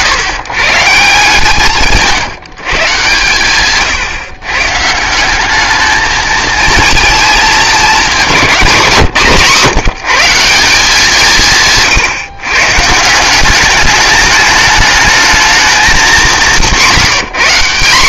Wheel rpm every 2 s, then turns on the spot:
150, 150, 140, 220, 190, 180, 150, 210, 190.
none